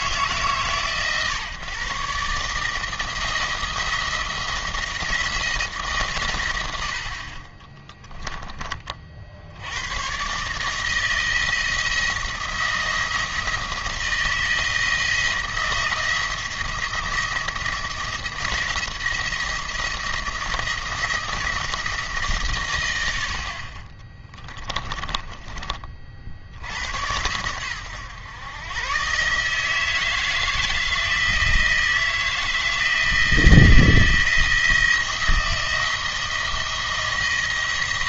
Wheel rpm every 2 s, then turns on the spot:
140, 150, 170, 90, 20, 150, 170, 160, 170, 170, 170, 120, 10, 80, 120, 160, 160, 170, 170.
24-26